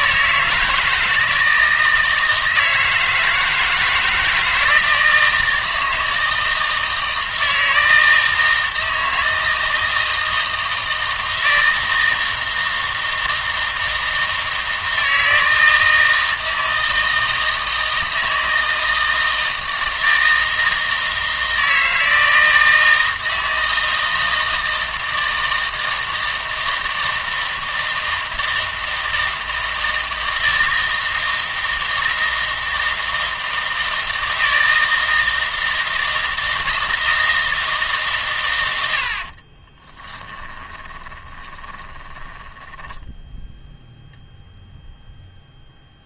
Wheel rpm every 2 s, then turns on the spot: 160, 160, 160, 160, 160, 160, 160, 160, 160, 160, 160, 160, 160, 160, 160, 160, 160, 160, 160, 100, 20, 10, 0.
40-44